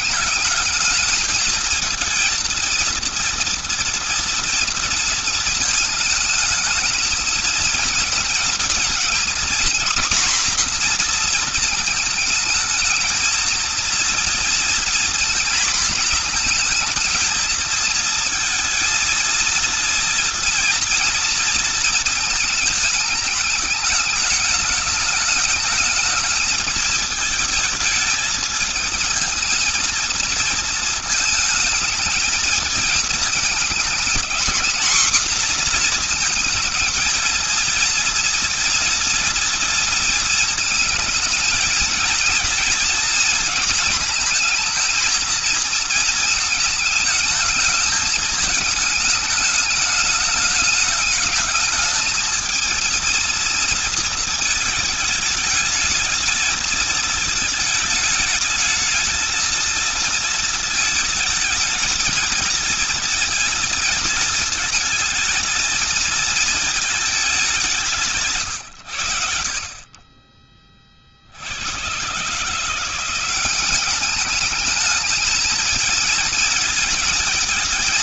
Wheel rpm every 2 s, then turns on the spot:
210, 230, 230, 220, 230, 250, 220, 230, 220, 230, 230, 220, 210, 220, 220, 230, 220, 220, 230, 230, 230, 230, 230, 220, 210, 210, 220, 220, 220, 220, 220, 220, 220, 220, 130, 20, 150, 210, 220.
none